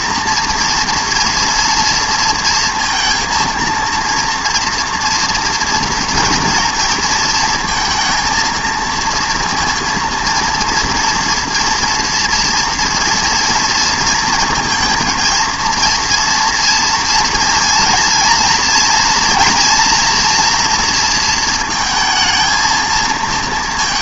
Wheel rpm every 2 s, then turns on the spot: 230, 230, 240, 230, 230, 230, 230, 230, 230, 230, 240, 230.
none